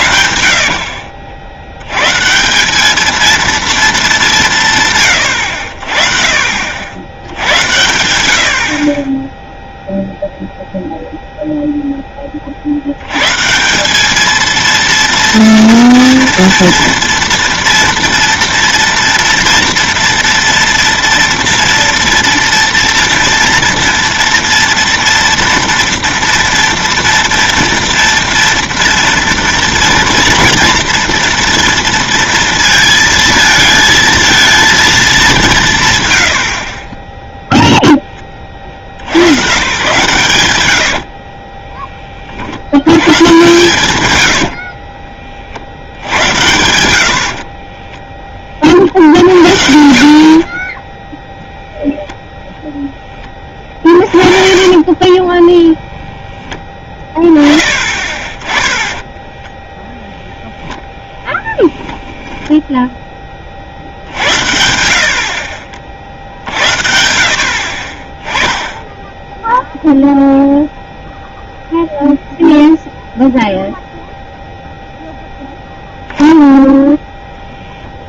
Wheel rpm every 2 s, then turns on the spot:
50, 190, 150, 80, 30, 0, 70, 230, 230, 230, 230, 230, 230, 240, 230, 230, 230, 220, 30, 60, 80, 80, 50, 80, 50, 10, 10, 30, 10, 20, 0, 10, 80, 80, 10, 0, 0, 0, 0.
0-2 36-38 40-42 44-46 50-52 54-56